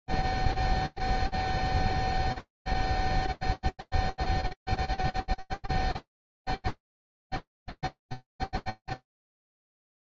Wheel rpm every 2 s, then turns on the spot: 0, 0, 0, 0, 0.
none